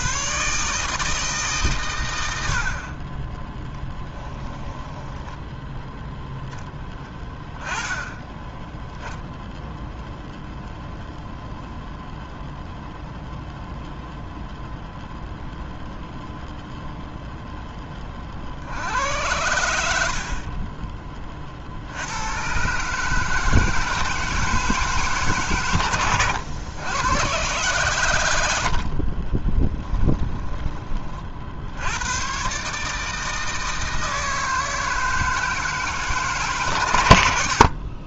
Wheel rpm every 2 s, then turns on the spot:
150, 40, 10, 10, 10, 0, 0, 0, 0, 80, 20, 130, 150, 110, 50, 30, 140, 160, 120.
4-6 28-30